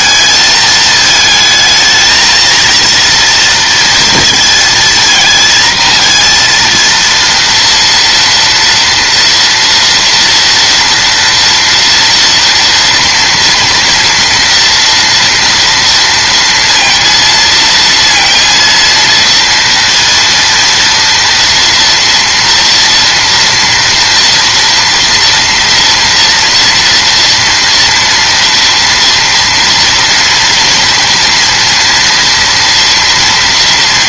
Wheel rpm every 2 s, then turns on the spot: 220, 230, 220, 230, 230, 230, 230, 230, 230, 230, 230, 230, 240, 230, 230, 230, 230.
none